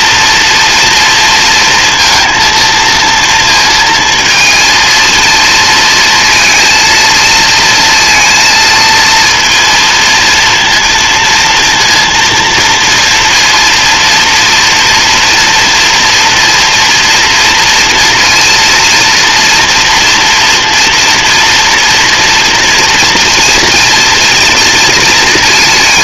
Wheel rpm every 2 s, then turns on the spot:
230, 230, 230, 230, 230, 230, 230, 230, 230, 230, 240, 230, 230.
none